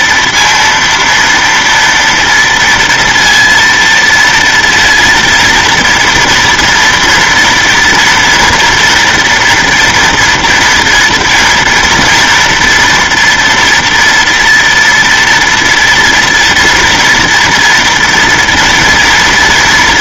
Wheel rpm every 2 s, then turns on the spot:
230, 230, 230, 230, 240, 230, 230, 230, 230, 230.
none